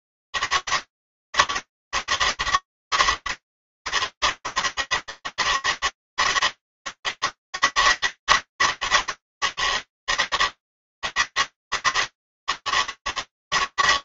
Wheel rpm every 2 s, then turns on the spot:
200, 190, 200, 200, 200, 200, 200.
none